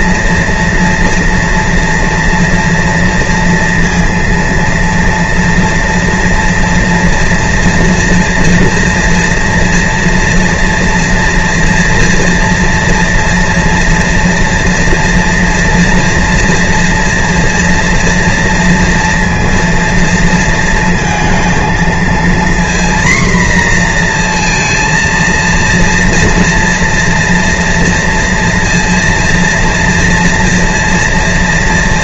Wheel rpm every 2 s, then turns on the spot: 230, 230, 230, 230, 230, 230, 230, 230, 230, 230, 230, 240, 230, 230, 230, 230.
none